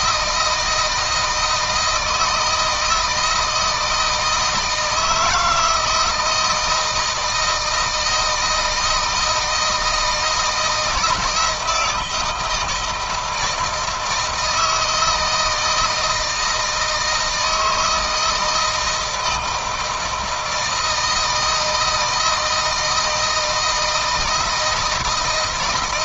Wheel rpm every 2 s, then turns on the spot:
160, 160, 160, 170, 160, 160, 160, 160, 160, 160, 160, 160, 160.
none